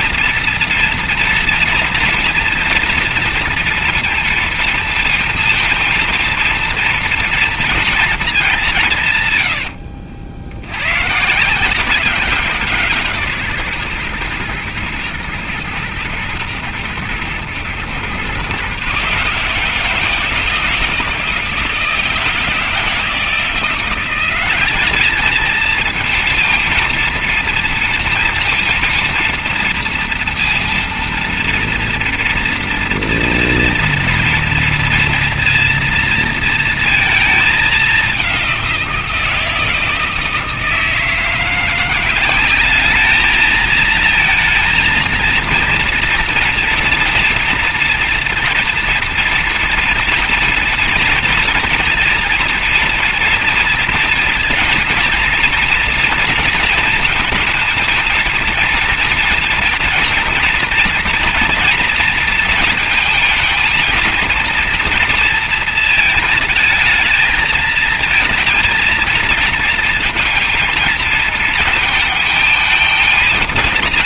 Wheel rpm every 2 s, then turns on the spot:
230, 230, 230, 230, 200, 90, 180, 120, 110, 130, 160, 160, 200, 230, 230, 230, 230, 230, 230, 180, 160, 200, 230, 230, 230, 230, 230, 230, 230, 230, 230, 220, 230, 220, 220, 230, 220.
none